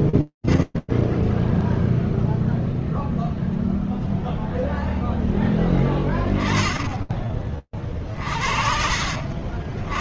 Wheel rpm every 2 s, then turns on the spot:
10, 0, 0, 20, 70.
none